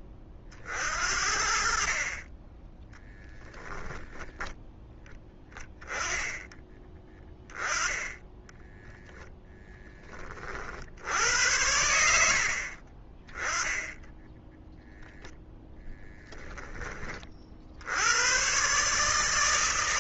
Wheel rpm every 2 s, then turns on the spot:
20, 10, 10, 10, 10, 40, 70, 10, 10, 120.
8-10